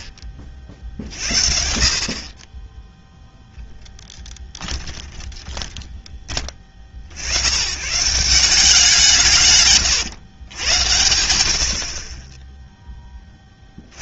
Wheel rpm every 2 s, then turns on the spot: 50, 0, 20, 50, 170, 100, 40.
4-6